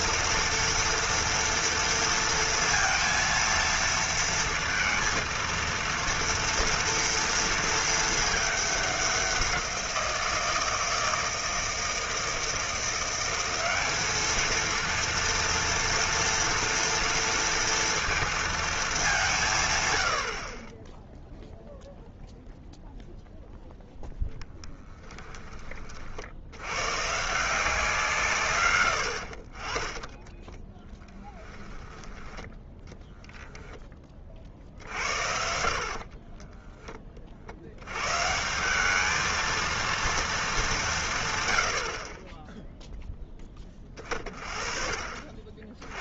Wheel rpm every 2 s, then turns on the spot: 230, 230, 230, 230, 200, 160, 170, 230, 230, 220, 20, 0, 10, 110, 120, 10, 10, 60, 20, 200, 190, 0, 40.
30-32